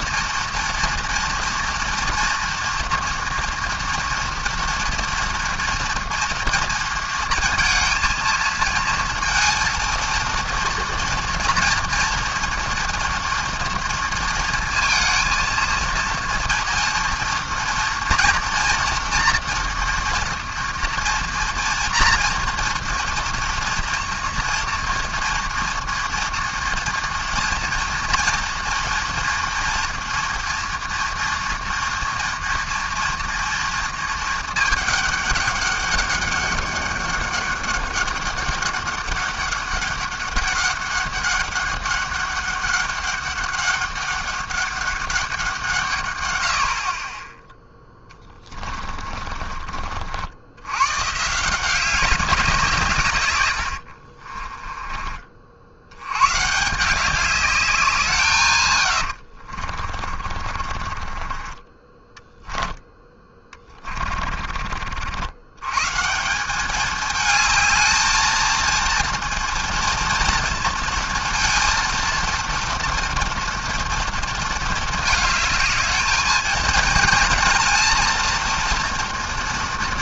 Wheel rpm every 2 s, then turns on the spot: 230, 230, 230, 230, 230, 230, 230, 230, 230, 230, 240, 240, 240, 230, 230, 230, 230, 210, 200, 200, 200, 200, 200, 70, 30, 100, 170, 20, 150, 120, 40, 10, 40, 200, 230, 230, 230, 230, 220, 230.
48-50 54-56 60-62